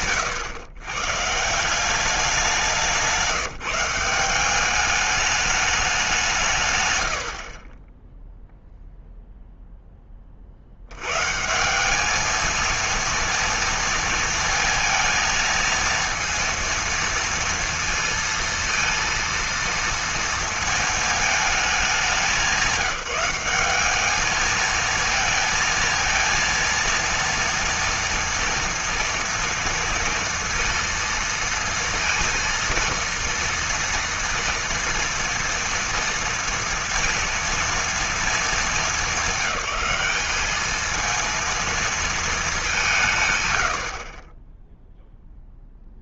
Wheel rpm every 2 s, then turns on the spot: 130, 190, 200, 140, 0, 70, 230, 230, 230, 230, 220, 180, 220, 230, 230, 230, 230, 230, 230, 220, 220, 190, 10.
none